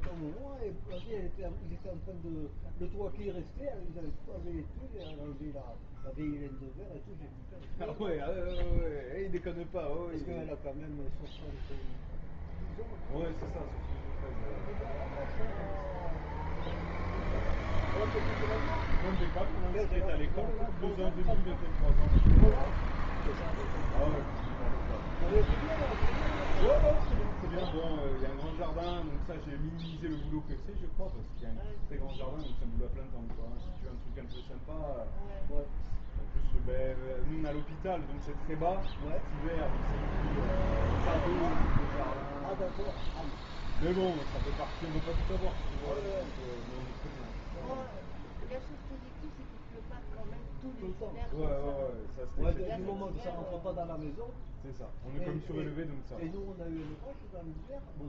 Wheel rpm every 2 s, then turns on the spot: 0, 0, 0, 0, 0, 0, 0, 0, 0, 0, 0, 0, 0, 0, 0, 0, 0, 0, 0, 0, 0, 0, 0, 0, 0, 0, 0, 0, 0.
none